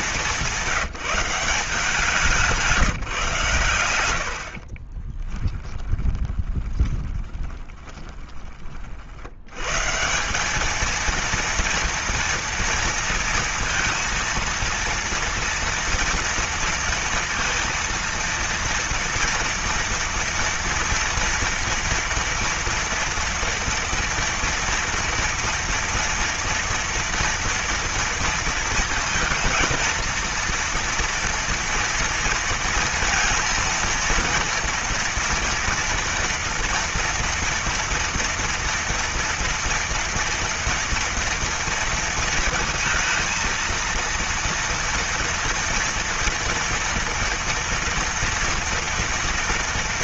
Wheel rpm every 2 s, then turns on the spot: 190, 170, 60, 20, 20, 200, 230, 230, 230, 230, 230, 230, 230, 230, 220, 230, 230, 230, 230, 240, 230, 230, 230, 240, 230.
4-8